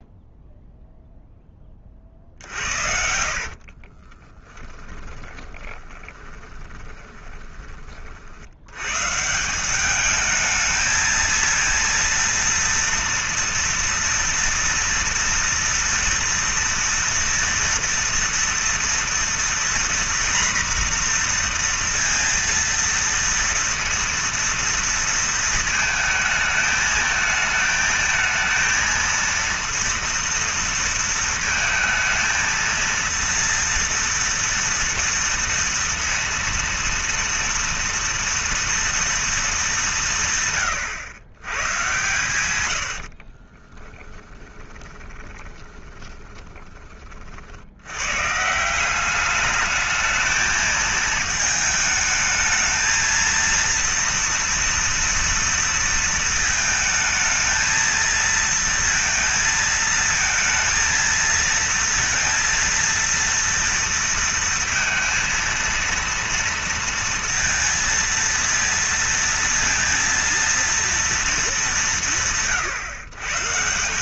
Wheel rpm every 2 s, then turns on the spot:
0, 60, 10, 10, 80, 220, 230, 230, 230, 230, 240, 230, 230, 220, 230, 230, 230, 230, 230, 230, 140, 90, 20, 20, 160, 220, 220, 230, 220, 230, 230, 230, 230, 230, 230, 230, 130.
2-8 44-48